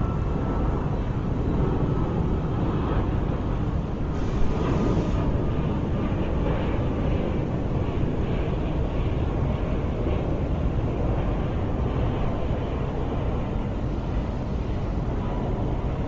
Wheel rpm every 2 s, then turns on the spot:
0, 0, 0, 0, 0, 0, 0, 0.
none